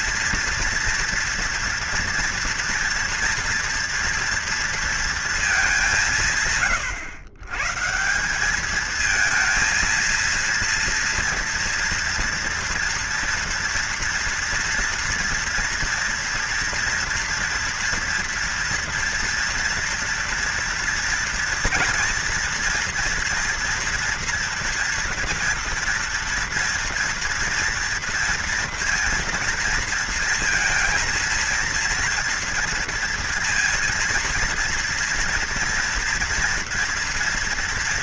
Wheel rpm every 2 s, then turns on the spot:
230, 240, 230, 120, 200, 230, 230, 230, 230, 230, 230, 240, 230, 240, 230, 230, 230, 230, 230.
none